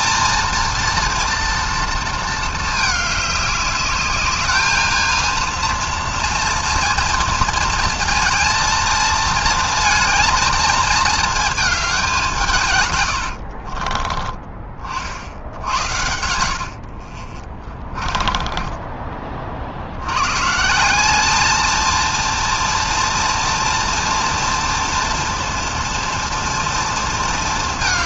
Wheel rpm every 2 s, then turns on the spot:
230, 220, 210, 230, 230, 230, 150, 30, 60, 20, 140, 230, 230, 230.
18-20